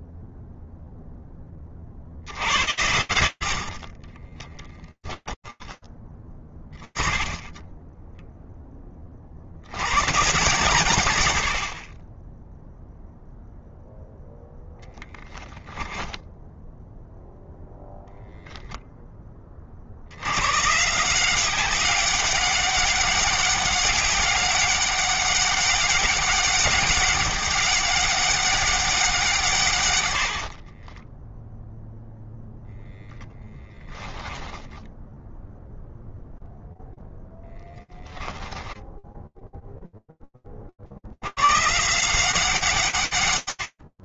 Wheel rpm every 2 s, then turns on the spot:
60, 40, 20, 10, 90, 50, 0, 20, 0, 60, 190, 200, 200, 200, 150, 0, 0, 0, 10, 10, 170, 40.
2-6 14-16